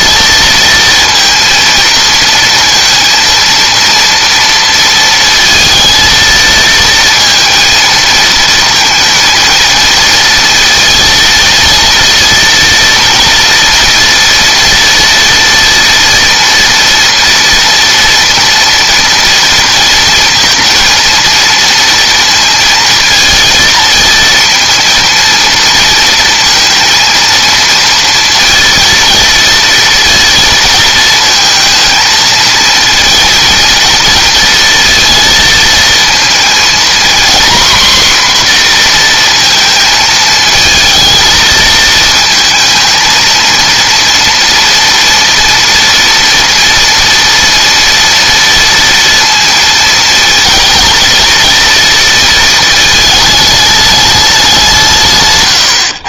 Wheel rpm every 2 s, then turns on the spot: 230, 230, 230, 230, 230, 230, 230, 230, 230, 230, 230, 230, 230, 230, 230, 230, 220, 230, 230, 240, 220, 230, 230, 230, 230, 220, 220, 170.
none